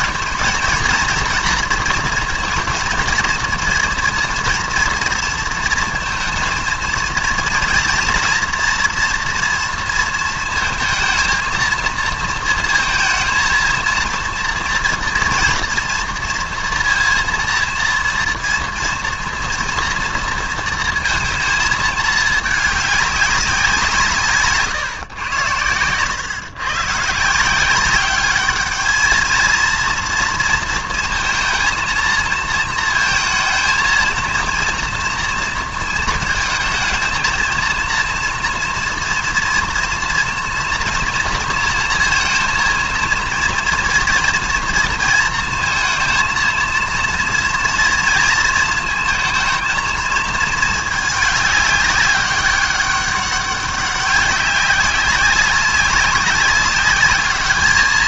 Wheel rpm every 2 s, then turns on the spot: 220, 230, 230, 230, 230, 220, 220, 230, 230, 230, 230, 210, 140, 120, 210, 230, 230, 230, 220, 230, 230, 230, 230, 230, 230, 220, 200, 200, 200.
none